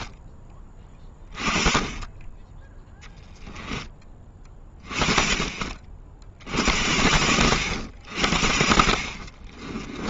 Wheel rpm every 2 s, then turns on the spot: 20, 10, 20, 80, 50.
none